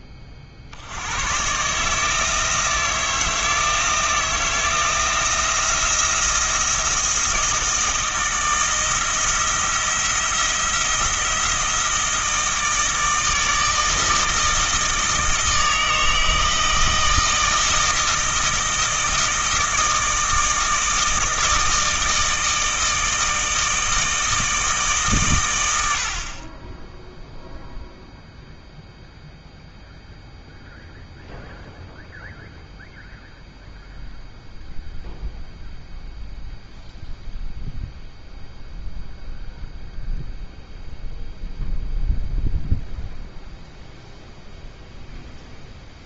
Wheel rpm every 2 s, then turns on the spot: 50, 160, 170, 170, 160, 170, 160, 160, 160, 160, 160, 160, 160, 20, 0, 0, 0, 0, 0, 0, 0, 0, 0.
none